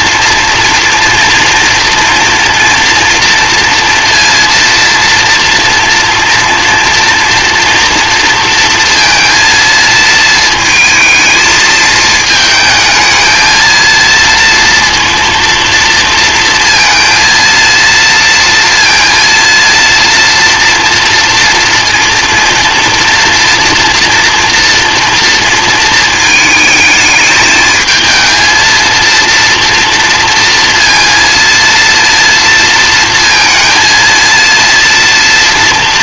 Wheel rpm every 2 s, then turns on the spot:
240, 230, 230, 230, 230, 220, 220, 230, 230, 230, 230, 230, 230, 220, 230, 230, 230, 230.
none